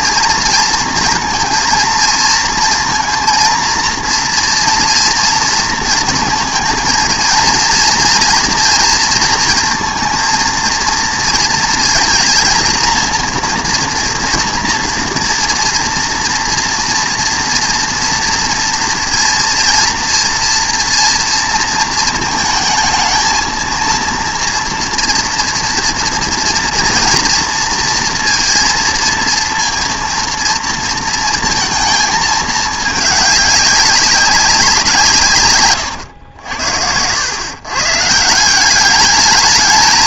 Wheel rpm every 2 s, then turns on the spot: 230, 230, 230, 230, 230, 230, 230, 230, 230, 230, 230, 220, 230, 230, 230, 230, 210, 170, 80, 190.
none